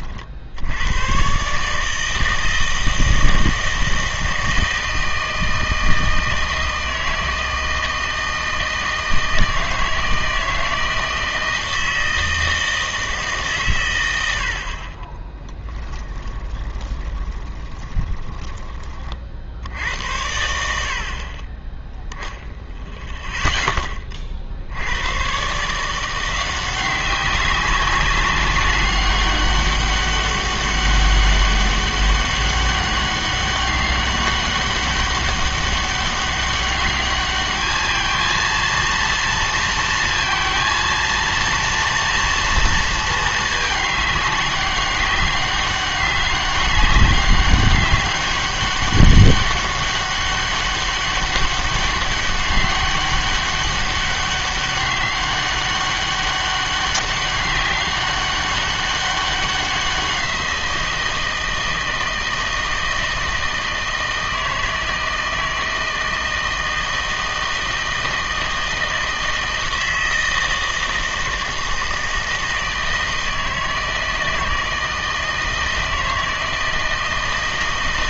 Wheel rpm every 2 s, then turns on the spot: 80, 160, 160, 160, 160, 160, 160, 40, 20, 30, 80, 0, 70, 180, 200, 200, 200, 200, 200, 230, 230, 230, 200, 200, 200, 200, 200, 190, 200, 200, 170, 160, 160, 160, 160, 160, 160, 160, 160.
16-18